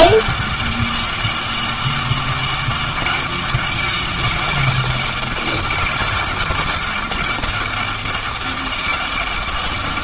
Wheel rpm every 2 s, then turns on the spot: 200, 200, 200, 200, 200.
none